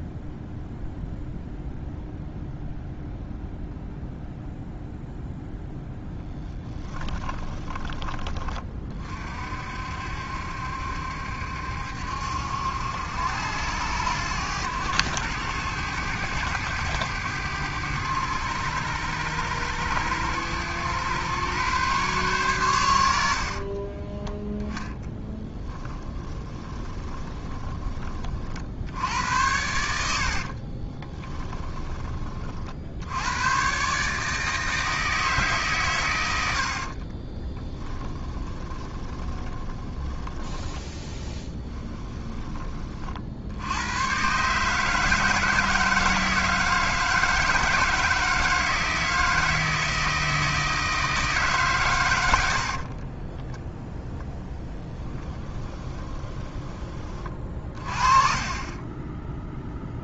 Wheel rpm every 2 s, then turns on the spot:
0, 0, 0, 20, 30, 70, 80, 100, 100, 100, 110, 100, 10, 20, 60, 40, 50, 160, 60, 20, 20, 30, 150, 160, 160, 160, 60, 0, 20, 20.
6-8 26-28 30-32 36-40 52-54 58-60